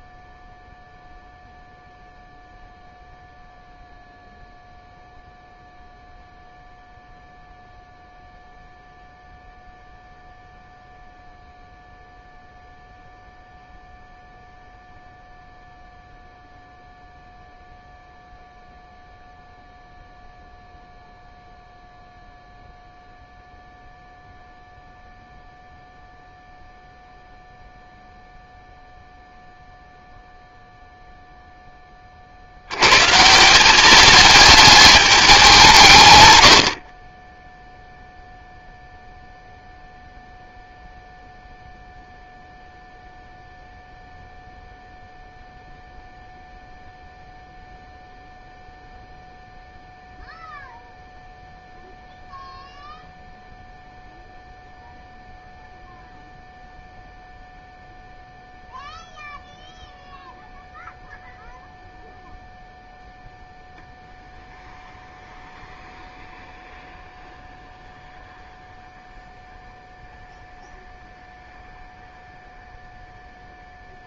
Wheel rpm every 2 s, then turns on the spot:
0, 0, 0, 0, 0, 0, 0, 0, 0, 0, 0, 0, 0, 0, 0, 0, 160, 190, 10, 0, 0, 0, 0, 0, 0, 0, 0, 0, 0, 0, 0, 0, 0, 0, 0, 0, 0.
36-38